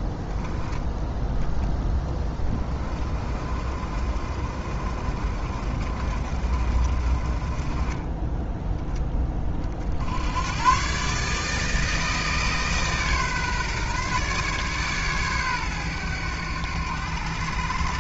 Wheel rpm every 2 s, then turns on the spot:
10, 30, 40, 40, 10, 130, 150, 140, 90.
none